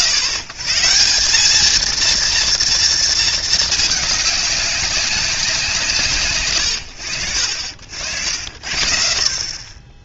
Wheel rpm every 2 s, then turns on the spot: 140, 230, 200, 80, 70.
none